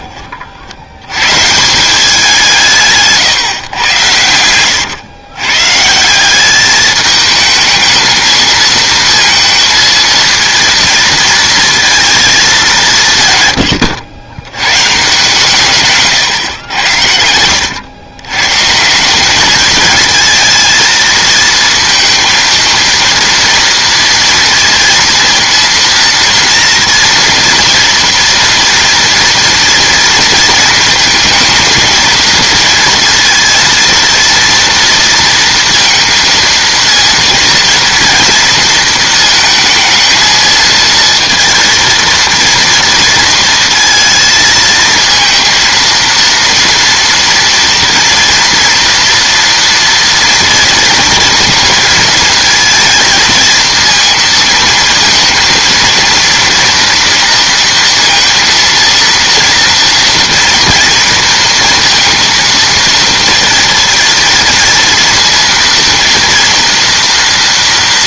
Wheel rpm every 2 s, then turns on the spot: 70, 160, 110, 200, 220, 230, 200, 110, 110, 140, 220, 230, 230, 230, 230, 230, 230, 230, 230, 230, 230, 230, 230, 230, 230, 230, 230, 230, 230, 230, 230, 230, 230, 230.
none